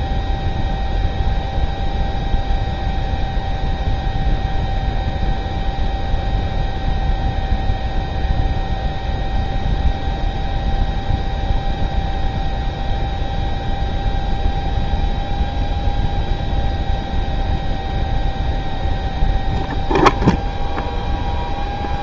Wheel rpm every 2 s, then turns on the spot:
0, 0, 0, 0, 0, 0, 0, 0, 0, 0, 0.
none